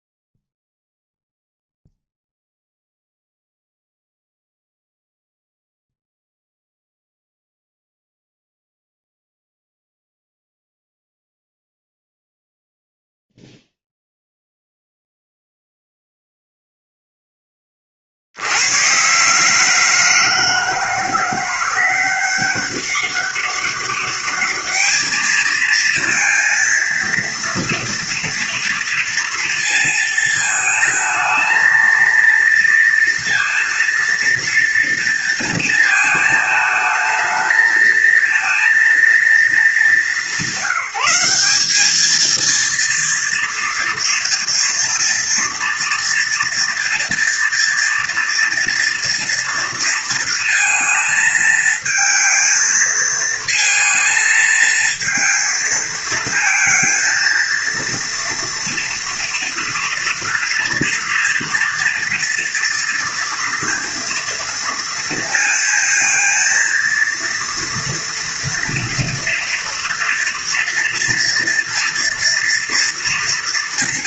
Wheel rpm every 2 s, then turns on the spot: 0, 0, 0, 0, 0, 0, 0, 0, 0, 100, 160, 190, 210, 230, 230, 220, 230, 230, 220, 230, 180, 230, 230, 240, 240, 230, 230, 220, 230, 230, 230, 230, 230, 230, 230, 230, 240.
none